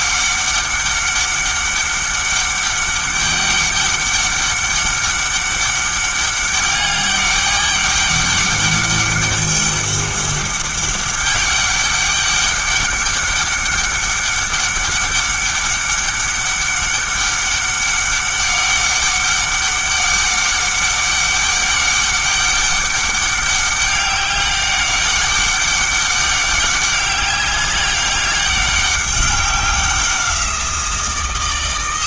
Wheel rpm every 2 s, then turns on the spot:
200, 200, 200, 200, 200, 200, 200, 200, 200, 200, 200, 200, 200, 200, 200, 170.
none